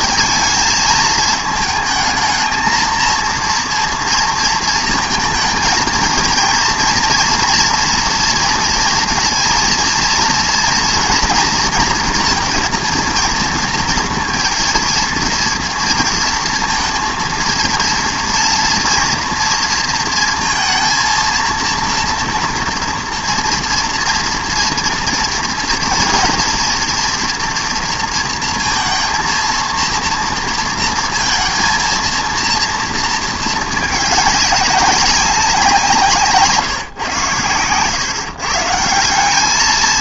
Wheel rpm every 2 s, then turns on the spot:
220, 220, 230, 230, 230, 230, 230, 230, 230, 230, 230, 240, 240, 230, 230, 230, 230, 200, 160, 160.
none